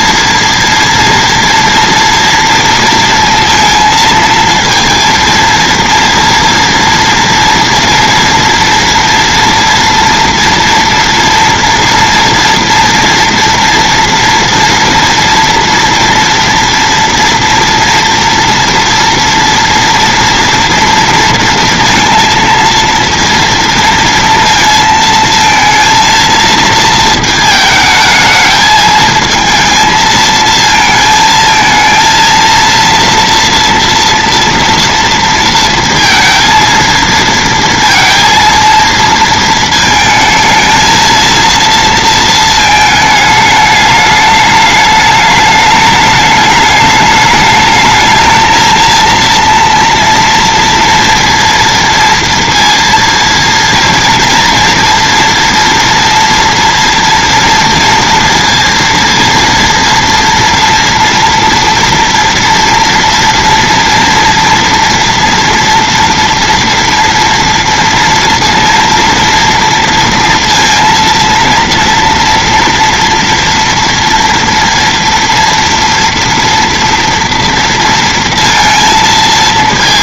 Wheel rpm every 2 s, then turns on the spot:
230, 230, 230, 230, 230, 240, 230, 240, 230, 230, 230, 230, 230, 220, 220, 220, 230, 230, 230, 230, 220, 220, 210, 210, 230, 230, 230, 230, 230, 230, 230, 240, 240, 230, 230, 230, 230, 230, 240, 230.
none